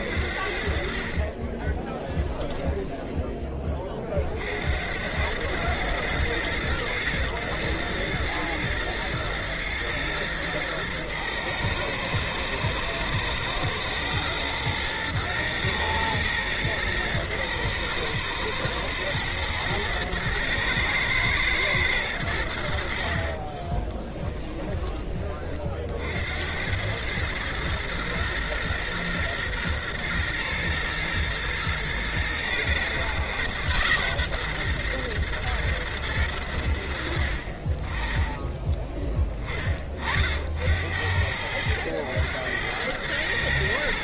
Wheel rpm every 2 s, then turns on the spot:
60, 10, 60, 110, 120, 110, 110, 110, 110, 120, 120, 80, 20, 80, 120, 120, 110, 120, 100, 20, 70, 100.
2-4 24-26 38-40